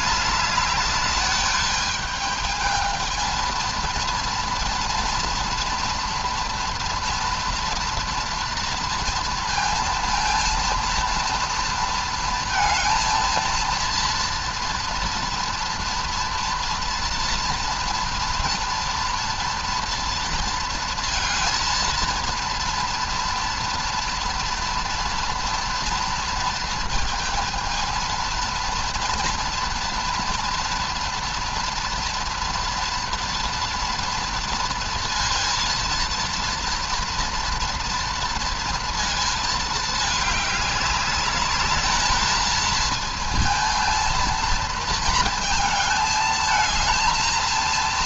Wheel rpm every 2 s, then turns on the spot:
210, 220, 230, 230, 230, 230, 230, 230, 230, 230, 230, 230, 230, 230, 230, 230, 230, 230, 230, 230, 210, 220, 230, 220.
none